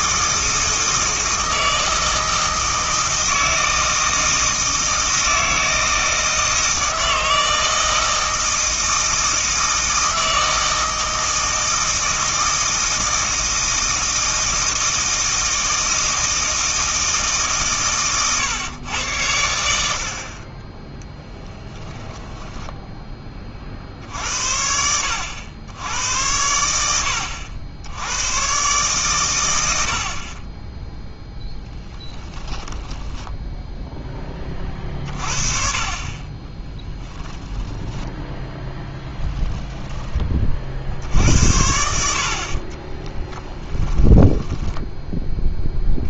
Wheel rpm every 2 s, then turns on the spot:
160, 160, 160, 160, 160, 160, 160, 160, 160, 110, 20, 10, 80, 90, 120, 10, 10, 40, 10, 20, 60, 40, 10.
32-34 36-38 42-46